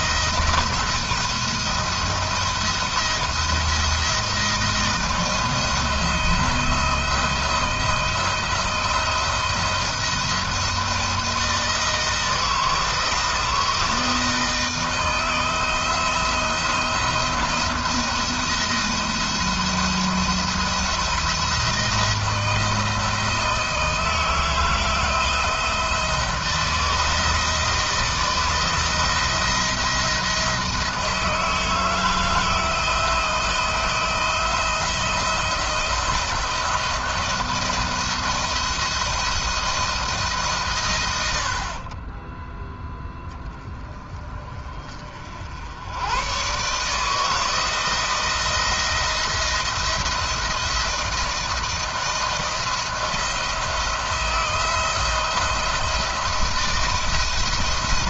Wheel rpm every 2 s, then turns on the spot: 170, 170, 160, 170, 170, 170, 170, 160, 170, 170, 170, 160, 160, 170, 170, 160, 160, 170, 170, 170, 100, 0, 40, 150, 170, 170, 170, 160, 160.
none